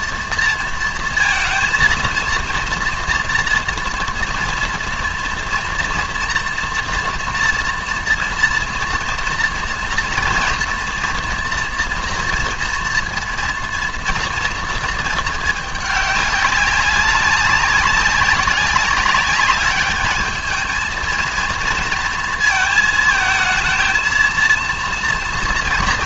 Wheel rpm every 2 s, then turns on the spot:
230, 230, 240, 230, 230, 230, 230, 230, 200, 190, 220, 220, 230.
none